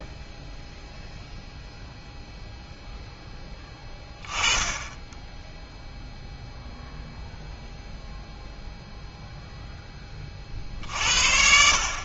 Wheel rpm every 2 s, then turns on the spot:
0, 0, 20, 0, 0, 50.
none